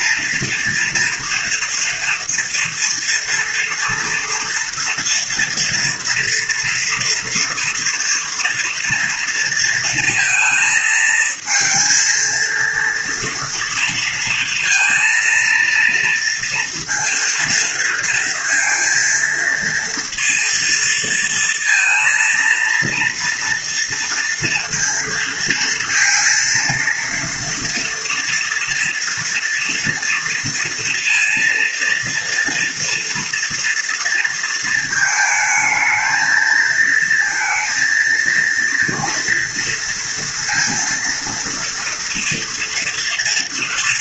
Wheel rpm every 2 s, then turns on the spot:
230, 240, 230, 230, 230, 220, 230, 230, 230, 230, 230, 240, 230, 230, 230, 230, 230, 220, 230, 230, 230, 230.
none